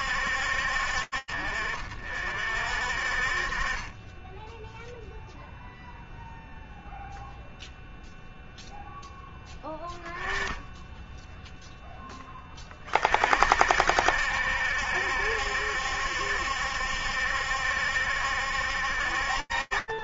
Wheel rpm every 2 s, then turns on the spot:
50, 30, 0, 0, 10, 0, 50, 70, 70, 50.
none